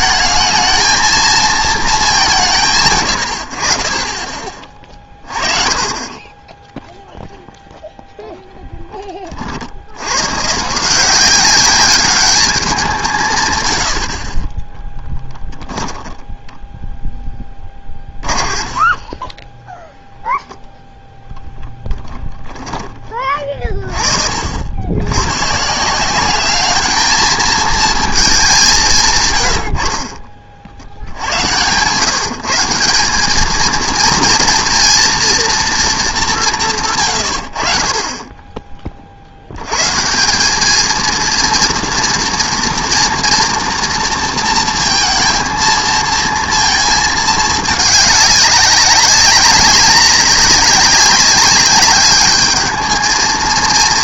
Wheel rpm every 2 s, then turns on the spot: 220, 160, 30, 20, 10, 140, 200, 20, 10, 30, 0, 10, 70, 210, 200, 70, 180, 230, 170, 20, 200, 240, 230, 220, 200, 200, 210.
18-20 22-24